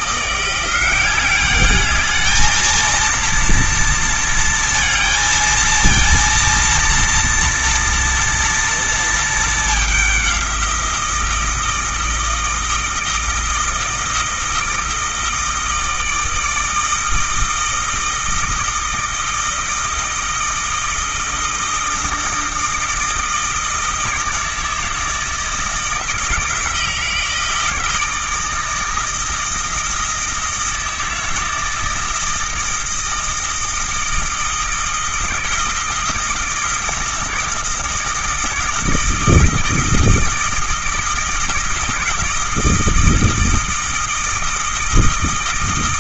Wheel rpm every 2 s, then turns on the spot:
180, 230, 230, 230, 230, 180, 170, 160, 160, 160, 160, 160, 160, 160, 160, 160, 160, 160, 160, 160, 160, 160, 160.
none